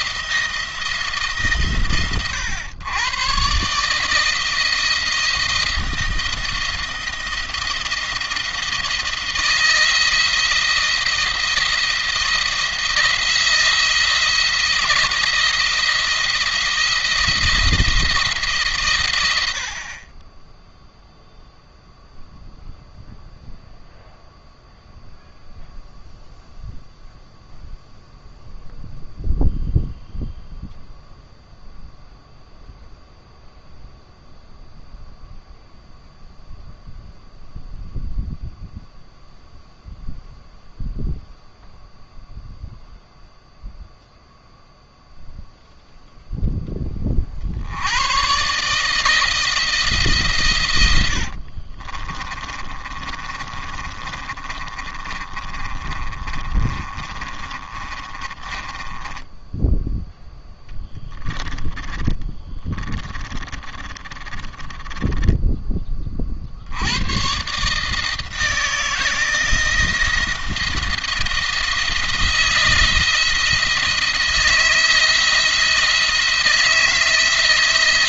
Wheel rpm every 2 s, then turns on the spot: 170, 120, 160, 170, 160, 170, 170, 170, 170, 130, 0, 0, 0, 0, 0, 0, 0, 0, 0, 0, 0, 0, 0, 10, 130, 110, 30, 30, 30, 20, 10, 30, 20, 70, 160, 160, 160, 160, 160.
50-66